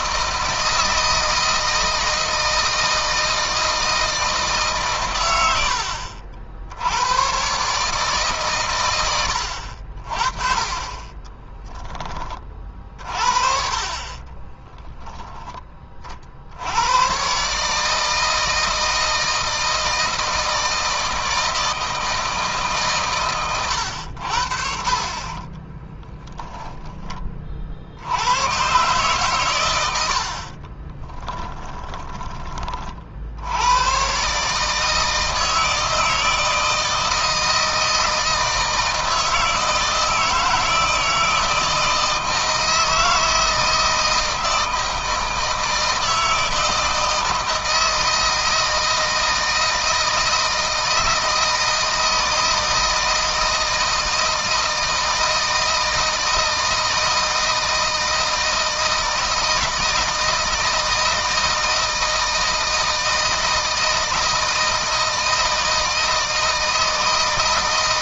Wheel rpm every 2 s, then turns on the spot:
160, 160, 130, 80, 110, 30, 40, 10, 100, 160, 160, 140, 50, 10, 120, 40, 40, 160, 160, 160, 160, 160, 160, 160, 160, 160, 160, 160, 160, 160, 160, 160, 160, 160.
30-32